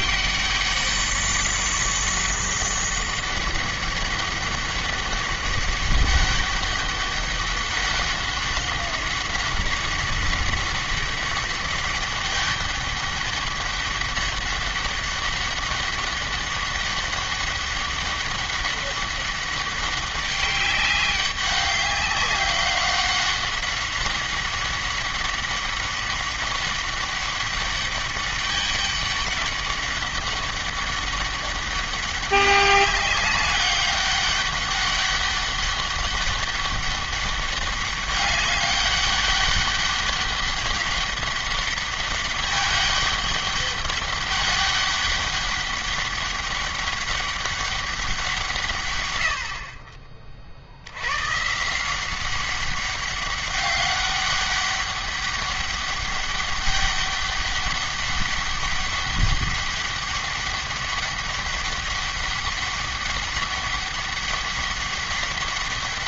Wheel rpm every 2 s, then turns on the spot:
200, 200, 200, 200, 190, 200, 200, 200, 200, 200, 200, 190, 200, 200, 200, 200, 200, 200, 200, 200, 200, 200, 200, 200, 120, 80, 200, 200, 200, 200, 200, 200, 200.
none